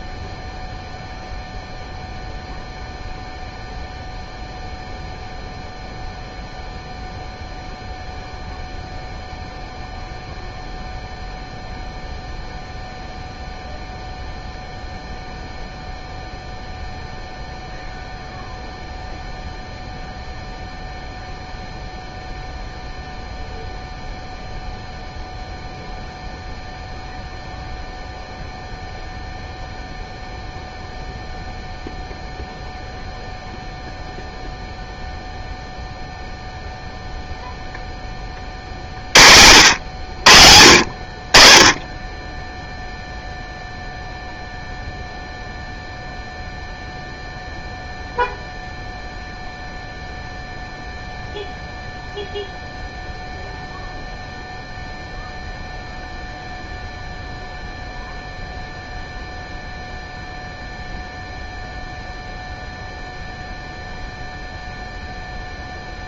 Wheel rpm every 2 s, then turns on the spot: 0, 0, 0, 0, 0, 0, 0, 0, 0, 0, 0, 0, 0, 0, 0, 0, 0, 0, 0, 40, 60, 0, 0, 0, 0, 0, 0, 0, 0, 0, 0, 0, 0.
none